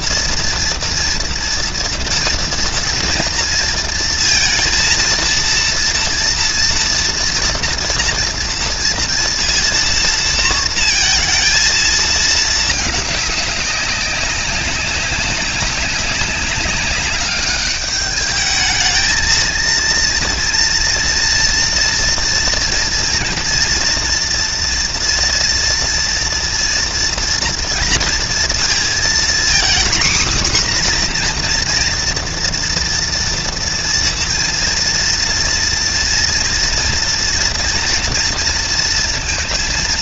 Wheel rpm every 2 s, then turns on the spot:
230, 230, 230, 230, 230, 230, 210, 200, 200, 220, 230, 230, 230, 230, 240, 260, 230, 230, 230, 230.
none